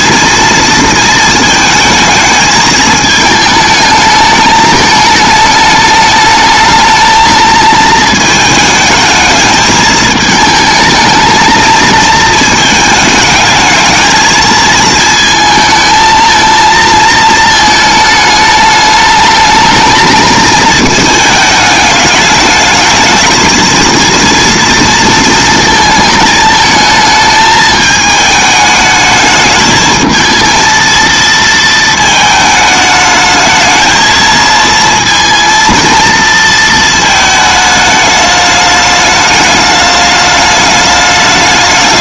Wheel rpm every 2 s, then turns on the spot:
230, 220, 220, 220, 220, 220, 220, 220, 220, 210, 220, 220, 230, 220, 220, 230, 210, 230, 230, 210, 210.
none